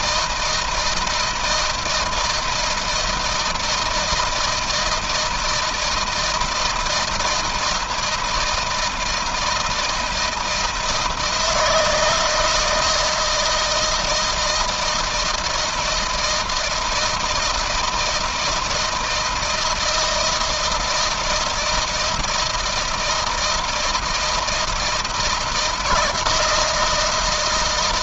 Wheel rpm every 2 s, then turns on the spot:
160, 170, 160, 160, 160, 160, 160, 160, 160, 160, 160, 160, 160, 160.
none